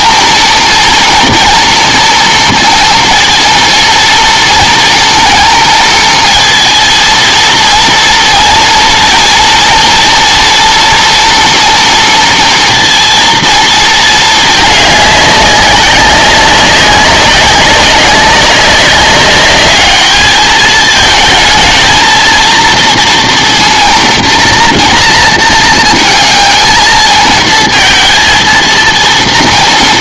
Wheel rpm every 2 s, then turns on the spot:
230, 230, 230, 230, 230, 240, 230, 210, 190, 200, 220, 230, 240, 230, 230.
none